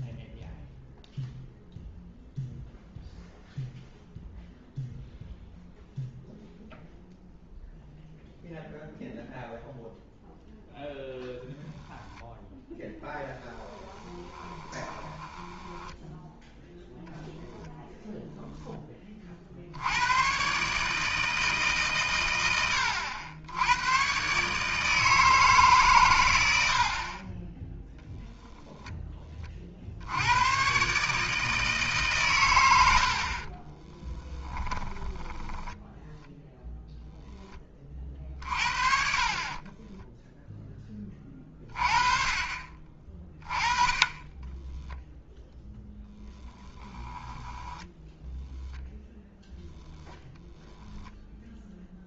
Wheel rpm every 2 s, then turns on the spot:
0, 0, 0, 0, 0, 0, 10, 20, 0, 20, 150, 100, 160, 70, 20, 140, 80, 10, 0, 50, 10, 30, 0, 10, 0, 0.
12-16 34-36 46-48